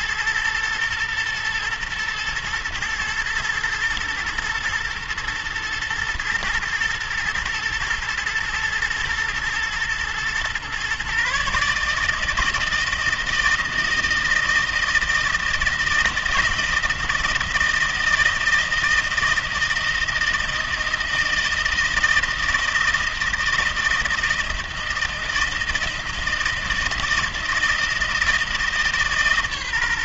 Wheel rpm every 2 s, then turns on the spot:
120, 120, 110, 120, 120, 120, 160, 160, 160, 160, 160, 160, 160, 160, 160.
none